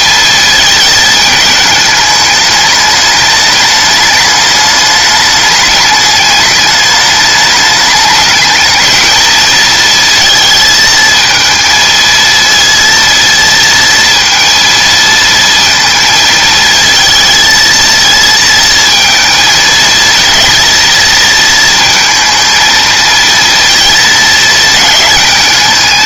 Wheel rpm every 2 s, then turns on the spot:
220, 210, 210, 210, 220, 220, 230, 230, 220, 230, 230, 220, 230.
none